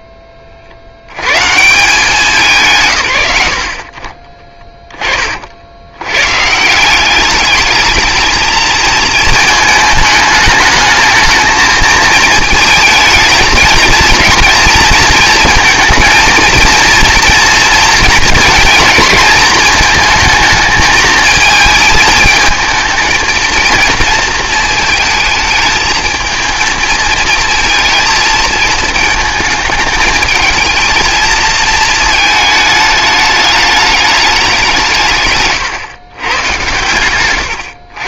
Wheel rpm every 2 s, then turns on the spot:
40, 130, 20, 160, 220, 220, 220, 230, 230, 230, 220, 220, 220, 220, 220, 220, 210, 180, 120.
none